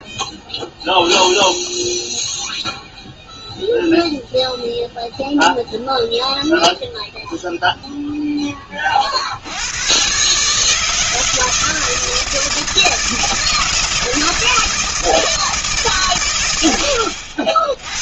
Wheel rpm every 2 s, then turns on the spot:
0, 0, 0, 0, 20, 150, 160, 160, 100.
none